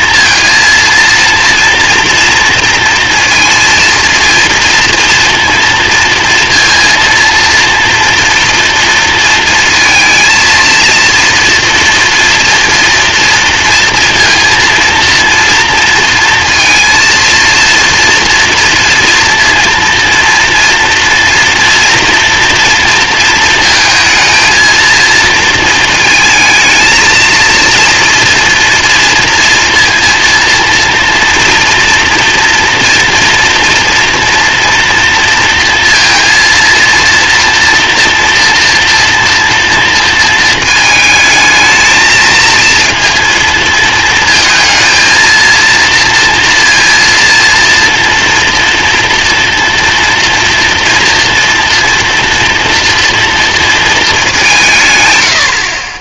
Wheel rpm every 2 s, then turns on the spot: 230, 230, 230, 230, 230, 230, 230, 230, 230, 230, 230, 230, 230, 220, 230, 230, 230, 230, 230, 240, 220, 230, 220, 230, 230, 230, 230, 150.
none